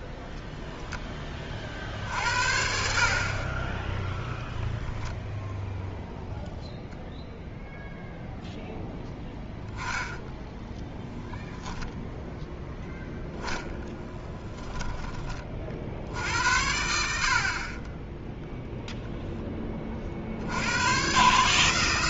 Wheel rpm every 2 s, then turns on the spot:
10, 70, 10, 0, 0, 0, 0, 10, 80, 0, 80.
0-2 14-16